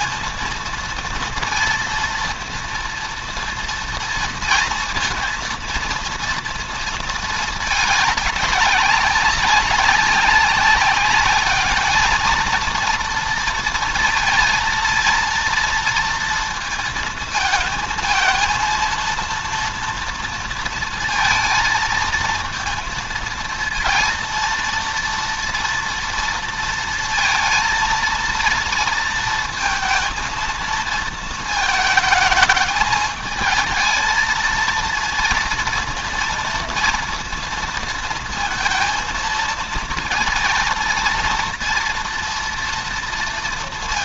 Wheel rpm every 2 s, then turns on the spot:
230, 230, 230, 220, 190, 200, 230, 230, 220, 230, 230, 230, 230, 230, 230, 230, 220, 230, 230, 230, 230, 230.
none